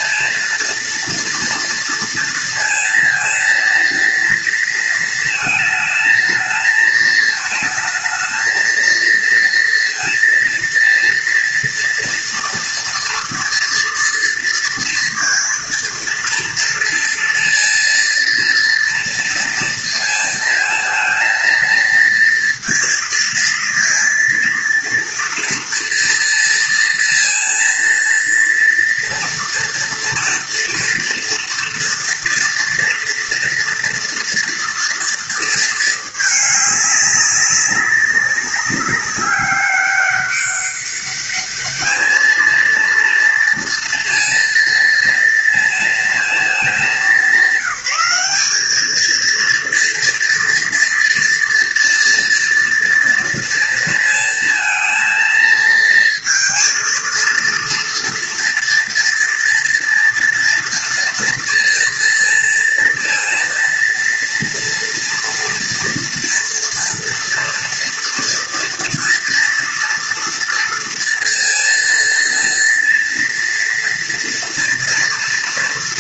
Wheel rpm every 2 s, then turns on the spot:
230, 230, 230, 220, 230, 230, 230, 230, 230, 230, 230, 230, 230, 230, 230, 230, 230, 230, 200, 200, 200, 230, 230, 220, 220, 230, 230, 230, 230, 230, 230, 230, 230, 230, 230, 240, 230, 230.
none